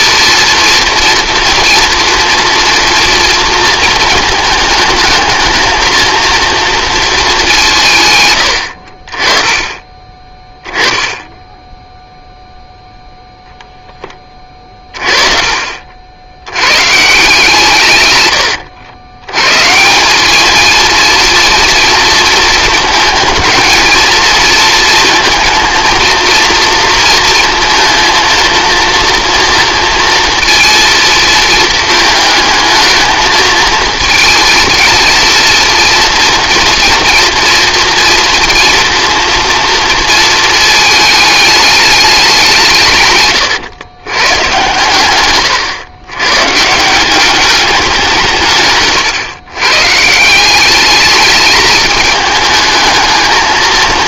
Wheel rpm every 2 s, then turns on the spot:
230, 230, 220, 230, 70, 20, 0, 30, 110, 90, 220, 220, 220, 230, 230, 230, 220, 230, 230, 230, 220, 170, 120, 150, 140, 200, 220.
10-12